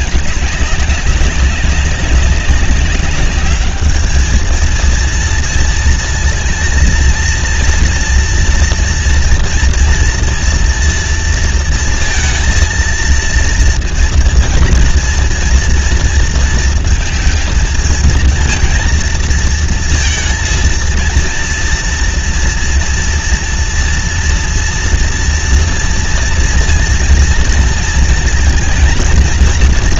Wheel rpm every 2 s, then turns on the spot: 200, 200, 220, 230, 230, 230, 230, 230, 230, 230, 230, 230, 230, 230, 230.
none